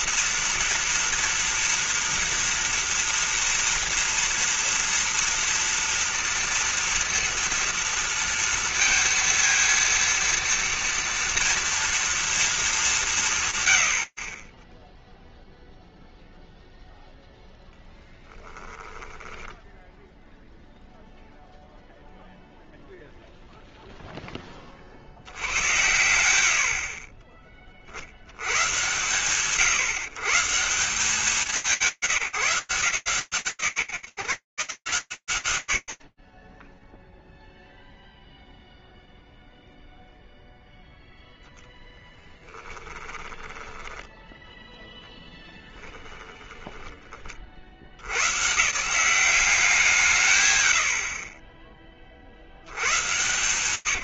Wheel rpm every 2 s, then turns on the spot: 230, 230, 230, 240, 230, 230, 230, 40, 0, 20, 0, 0, 20, 60, 100, 180, 160, 40, 0, 0, 20, 10, 10, 70, 180, 30, 130.
18-20 40-46